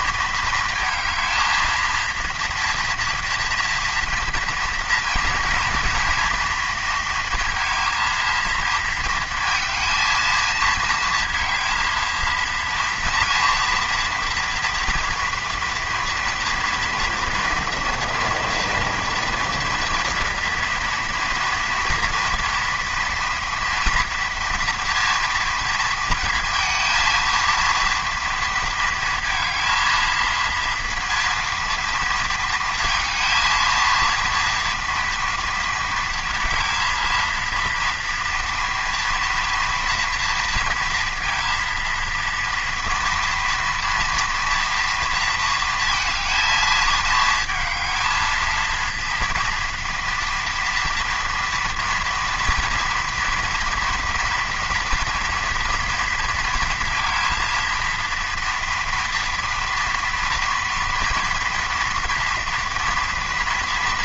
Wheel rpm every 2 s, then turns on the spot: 230, 230, 240, 230, 230, 220, 230, 230, 230, 230, 230, 230, 230, 230, 230, 230, 230, 230, 230, 230, 230, 230, 230, 220, 230, 240, 240, 230, 230, 230, 230, 240.
none